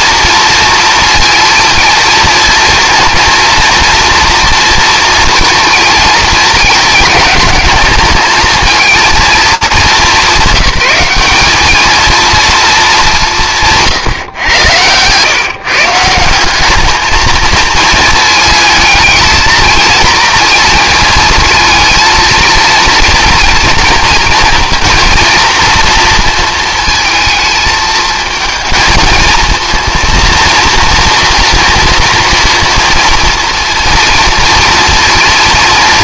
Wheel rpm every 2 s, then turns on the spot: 230, 230, 230, 220, 220, 190, 230, 110, 200, 220, 230, 230, 230, 230, 230, 230, 230, 230.
none